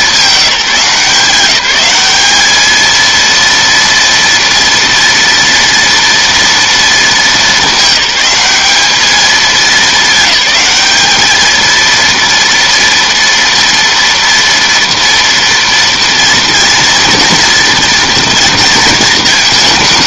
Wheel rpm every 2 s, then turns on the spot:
180, 230, 230, 210, 210, 210, 230, 230, 230, 220.
none